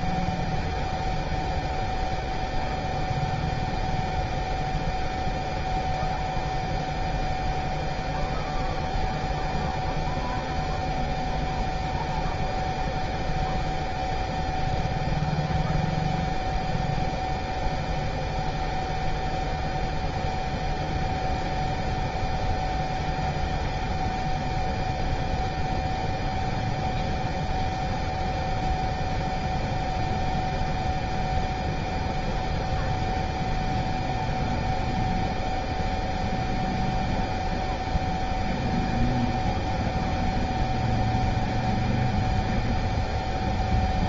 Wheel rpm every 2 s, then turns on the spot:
0, 0, 0, 0, 0, 0, 0, 0, 0, 0, 0, 0, 0, 0, 0, 0, 0, 0, 0, 0, 0, 0.
none